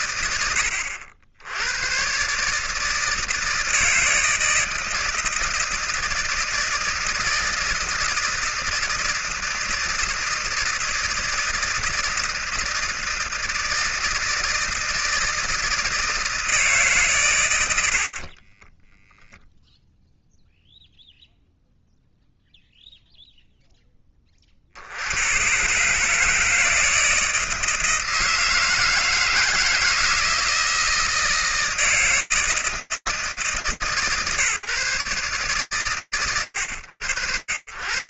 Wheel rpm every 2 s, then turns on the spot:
80, 160, 160, 160, 160, 160, 160, 160, 80, 0, 0, 0, 100, 160, 160, 160, 160, 140, 90.
none